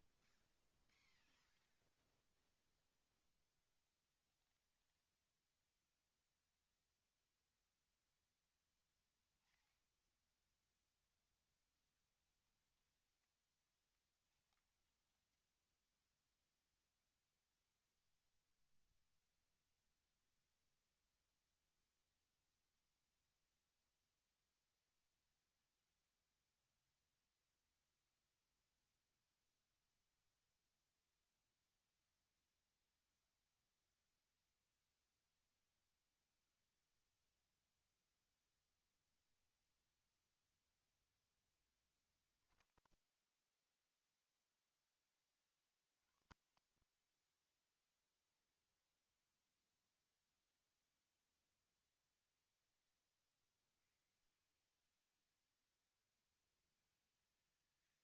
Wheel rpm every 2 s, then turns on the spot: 0, 0, 0, 0, 0, 0, 0, 0, 0, 0, 0, 0, 0, 0, 0, 0, 0, 0, 0, 0, 0, 10, 10, 60, 0, 0, 0, 0, 0.
42-44 46-48